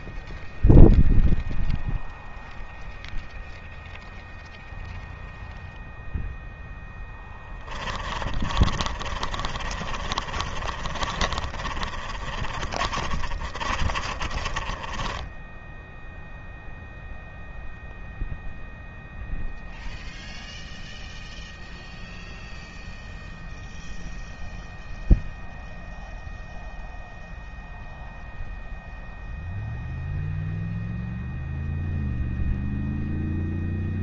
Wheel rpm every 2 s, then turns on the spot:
0, 0, 0, 0, 30, 30, 30, 20, 0, 0, 0, 0, 0, 0, 0, 0, 0.
8-16